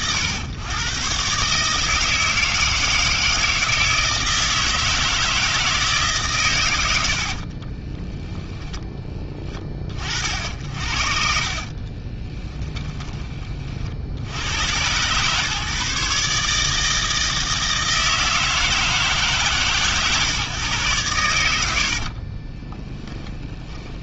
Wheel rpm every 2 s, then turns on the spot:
120, 160, 160, 110, 10, 60, 20, 100, 150, 160, 120, 20.
12-14 22-24